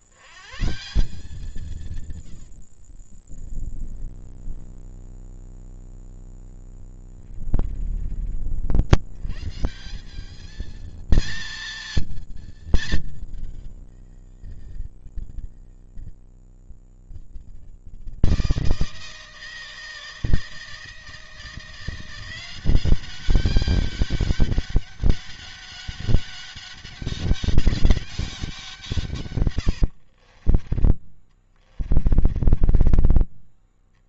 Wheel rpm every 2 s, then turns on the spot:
150, 90, 20, 20, 60, 220, 220, 170, 160, 160, 160, 190, 200, 200, 160, 20, 20.
2-4 6-8 30-34